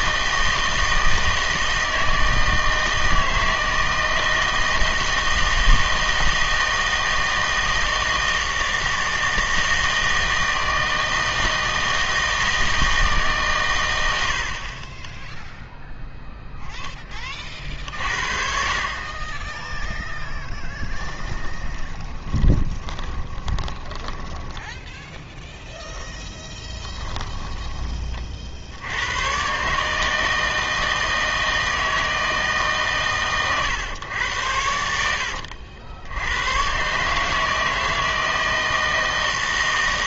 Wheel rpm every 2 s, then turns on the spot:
160, 160, 160, 160, 160, 160, 160, 30, 10, 40, 10, 30, 10, 10, 70, 160, 140, 80, 130, 160.
20-28